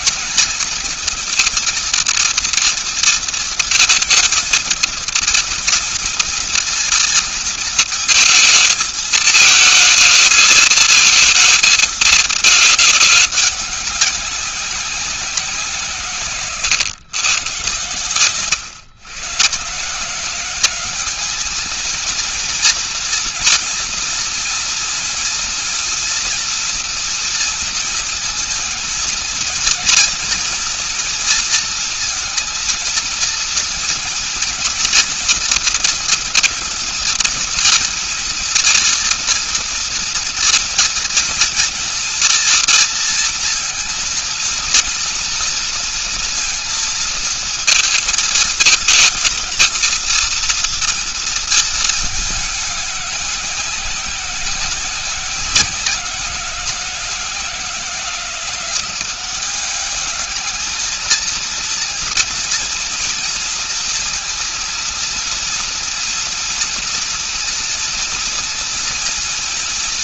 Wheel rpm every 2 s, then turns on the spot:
210, 230, 230, 230, 220, 220, 210, 190, 130, 120, 170, 230, 230, 230, 230, 230, 230, 230, 230, 230, 230, 240, 230, 230, 220, 230, 210, 180, 180, 180, 220, 230, 230, 230, 230.
16-18